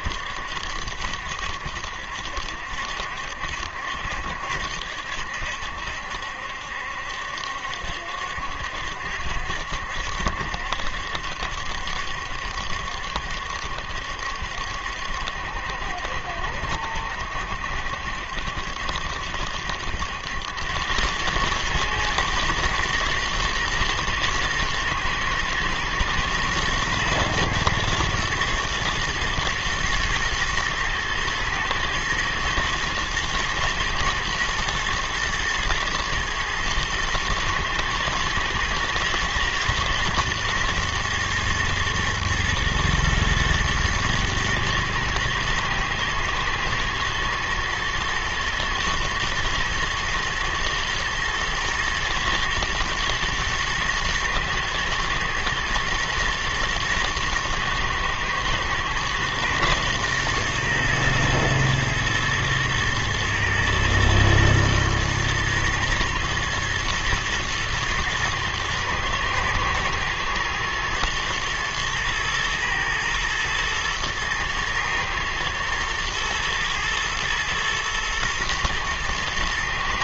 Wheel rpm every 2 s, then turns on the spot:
70, 70, 70, 70, 70, 70, 70, 70, 70, 70, 90, 110, 120, 120, 110, 110, 110, 110, 110, 110, 120, 110, 110, 110, 120, 120, 120, 110, 120, 120, 120, 120, 120, 110, 110, 120, 120, 110, 110, 120.
none